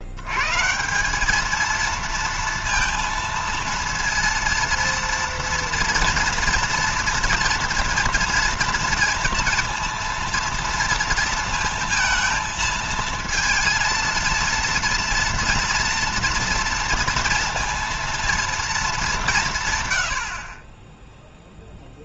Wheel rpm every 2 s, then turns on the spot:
170, 230, 230, 230, 230, 230, 230, 230, 230, 220, 30.
none